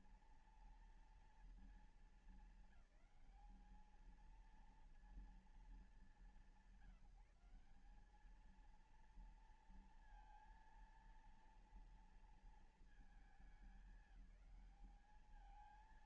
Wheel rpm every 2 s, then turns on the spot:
240, 200, 220, 190, 210, 230, 230, 210.
none